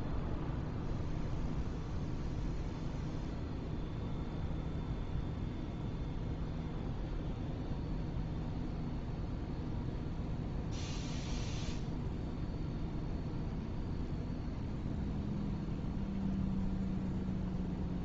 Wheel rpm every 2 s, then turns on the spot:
0, 0, 0, 0, 0, 0, 0, 0, 0.
none